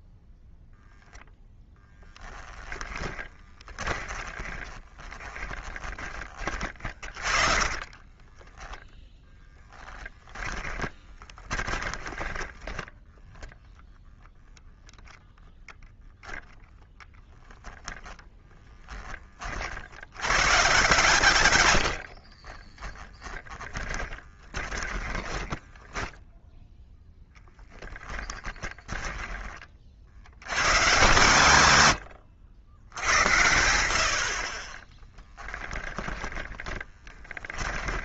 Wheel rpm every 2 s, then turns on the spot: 0, 10, 30, 30, 20, 10, 10, 0, 0, 10, 130, 40, 20, 0, 10, 130, 80, 30, 20.
2-12 22-26 28-30 36-38